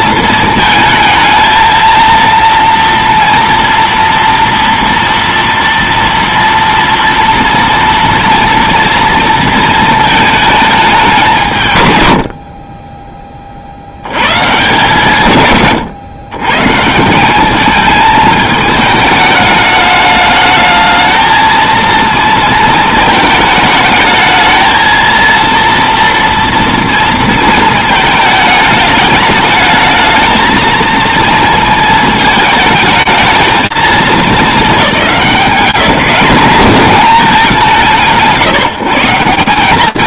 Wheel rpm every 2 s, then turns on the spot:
220, 230, 230, 230, 230, 170, 20, 150, 190, 210, 220, 220, 230, 230, 210, 230, 220, 200, 190, 170.
none